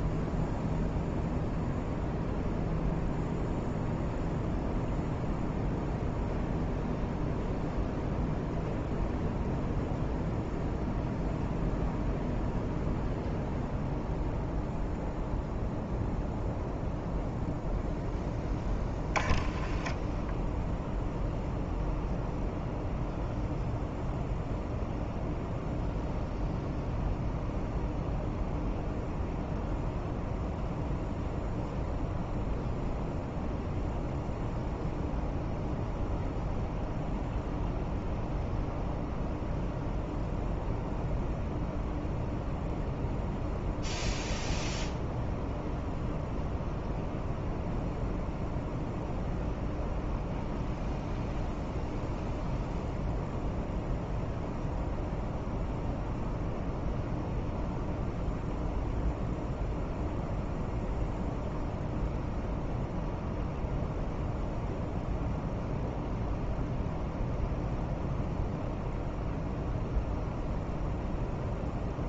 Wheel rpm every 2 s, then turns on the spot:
0, 0, 0, 0, 0, 0, 0, 0, 0, 10, 0, 0, 0, 0, 0, 0, 0, 0, 0, 0, 0, 0, 0, 0, 0, 0, 0, 0, 0, 0, 0, 0, 0, 0, 0, 0.
none